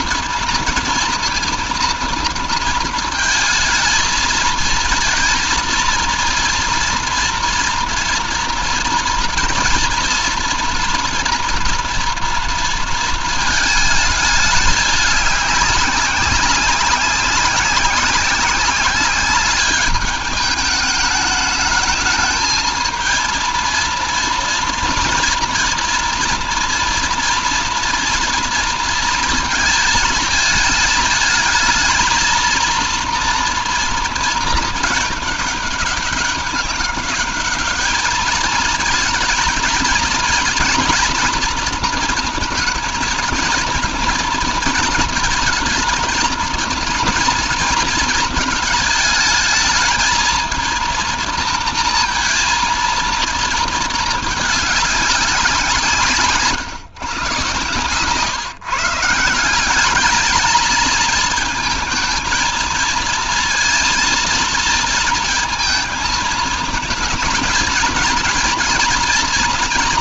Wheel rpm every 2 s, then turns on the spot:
230, 230, 230, 230, 230, 230, 230, 210, 190, 190, 210, 220, 230, 230, 230, 220, 230, 220, 200, 220, 240, 230, 230, 230, 220, 230, 230, 200, 130, 150, 210, 220, 230, 220, 240.
none